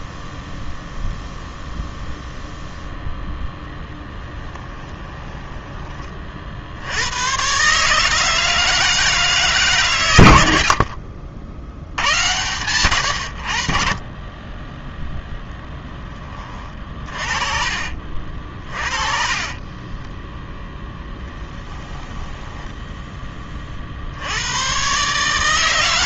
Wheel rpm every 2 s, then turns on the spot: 0, 0, 20, 50, 160, 90, 100, 20, 30, 40, 0, 10, 100.
4-6 16-20 22-24